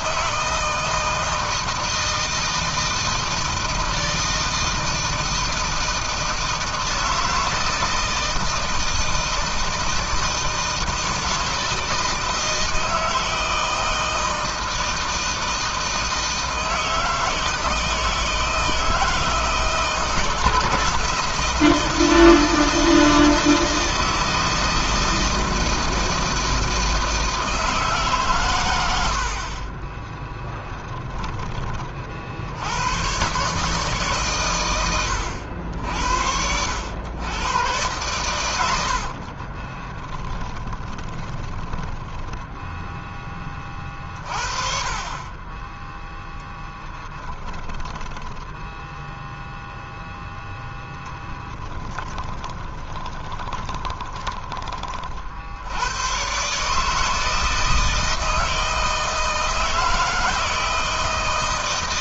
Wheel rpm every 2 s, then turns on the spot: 160, 160, 160, 170, 160, 160, 160, 160, 160, 160, 160, 160, 160, 160, 120, 10, 60, 120, 80, 100, 10, 10, 40, 10, 10, 0, 10, 20, 130, 160, 160.
30-32 40-44 48-50 52-54